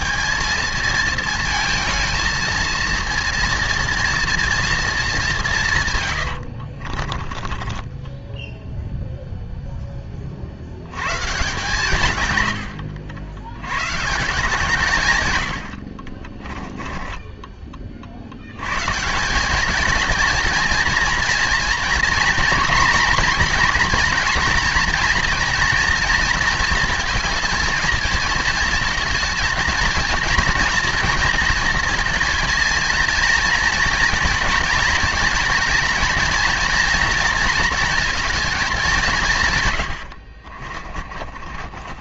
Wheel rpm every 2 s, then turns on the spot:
220, 230, 230, 60, 0, 80, 90, 150, 20, 120, 230, 240, 230, 230, 230, 230, 230, 230, 230, 210, 40.
6-8 16-18 40-42